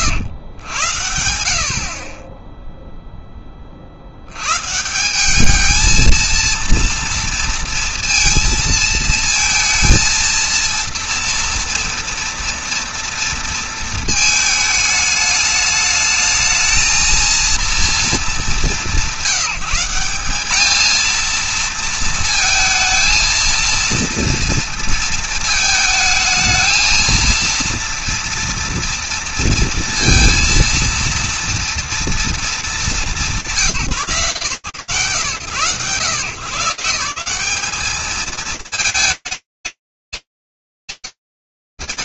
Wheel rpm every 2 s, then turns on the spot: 110, 30, 90, 220, 230, 230, 230, 220, 220, 210, 190, 230, 230, 220, 230, 230, 220, 130, 140, 210, 220.
none